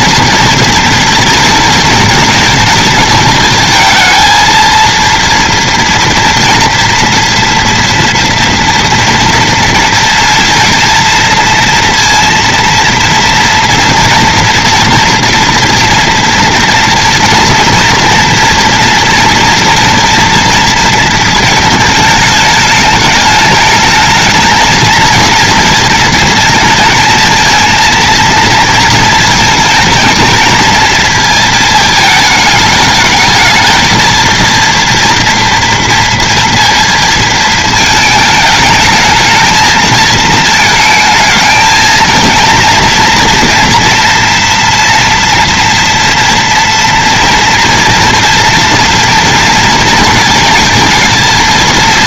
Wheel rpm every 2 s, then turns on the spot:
230, 230, 220, 230, 230, 230, 230, 230, 230, 230, 230, 210, 220, 220, 230, 230, 210, 230, 230, 210, 220, 230, 230, 230, 230, 230.
none